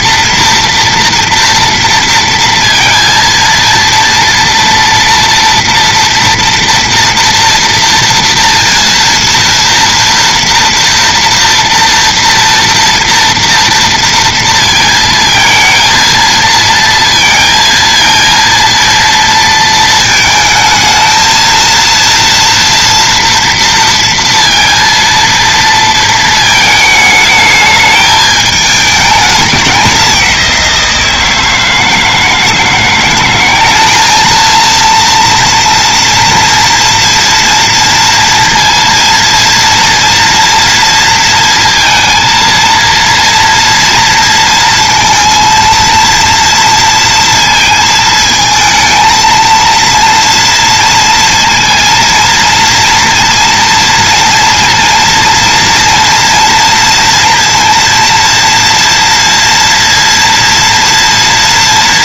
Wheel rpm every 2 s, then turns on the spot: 230, 230, 230, 240, 230, 230, 240, 230, 230, 230, 220, 230, 230, 220, 210, 180, 160, 220, 230, 230, 230, 230, 230, 230, 230, 230, 230, 230, 230, 240, 230.
none